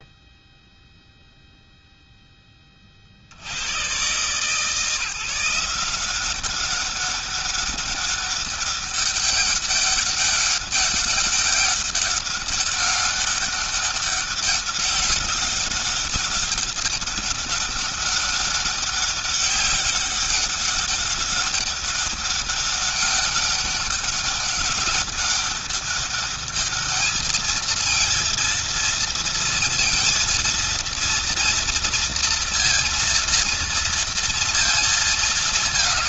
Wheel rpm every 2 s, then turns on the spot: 0, 30, 160, 200, 200, 200, 200, 200, 200, 200, 200, 200, 200, 210, 230, 230, 230, 220.
none